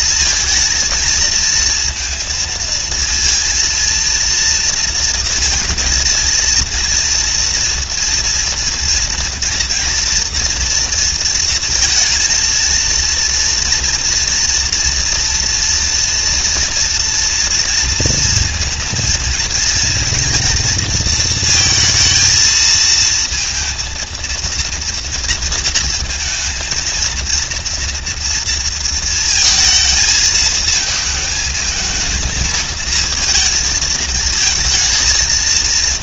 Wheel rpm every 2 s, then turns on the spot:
230, 230, 230, 230, 230, 230, 230, 230, 230, 230, 230, 220, 230, 230, 230, 220, 220, 220.
none